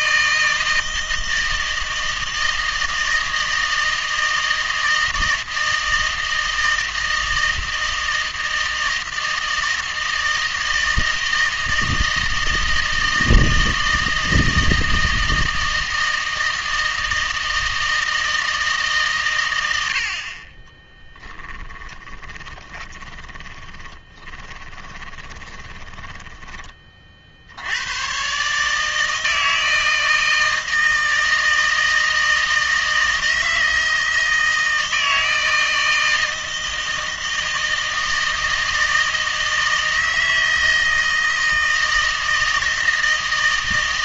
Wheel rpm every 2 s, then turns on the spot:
160, 160, 160, 160, 160, 160, 160, 160, 160, 150, 20, 20, 20, 30, 150, 160, 160, 160, 160, 160, 160, 160.
20-26